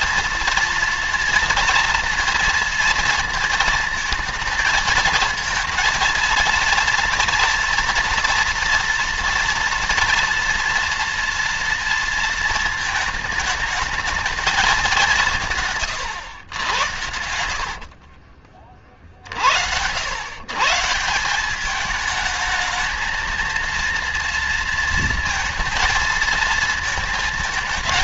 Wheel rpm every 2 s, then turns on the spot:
230, 230, 230, 230, 230, 230, 230, 210, 100, 40, 150, 220, 230, 230.
none